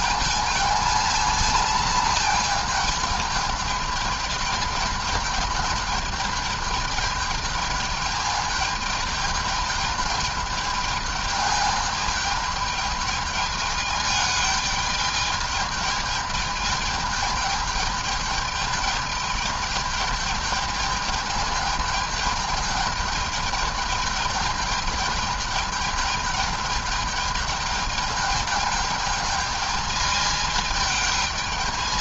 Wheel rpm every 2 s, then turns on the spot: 220, 220, 210, 210, 210, 210, 210, 210, 210, 210, 210, 220, 210, 210, 220, 220.
none